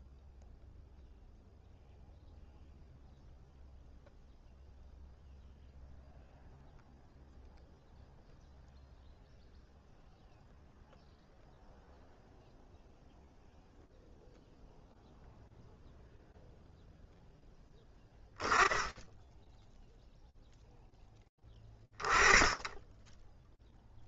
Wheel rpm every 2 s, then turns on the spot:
0, 0, 0, 0, 0, 0, 0, 0, 0, 0, 20, 0.
none